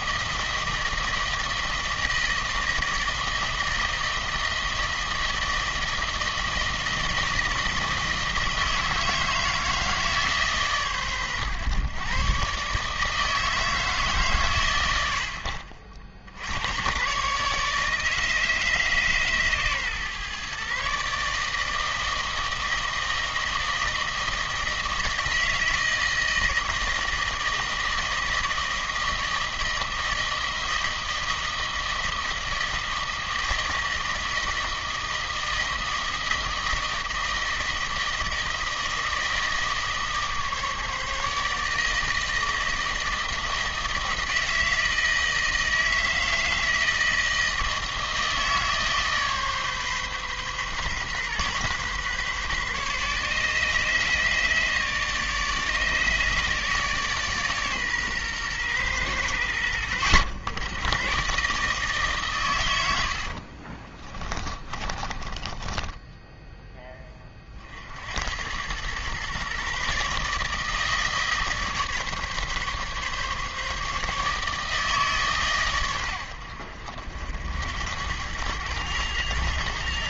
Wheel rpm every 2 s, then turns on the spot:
160, 160, 160, 160, 160, 130, 150, 90, 120, 150, 140, 160, 160, 160, 160, 160, 160, 160, 160, 160, 150, 160, 160, 160, 150, 130, 140, 150, 150, 110, 120, 90, 20, 20, 110, 160, 140, 150, 70, 110.
62-66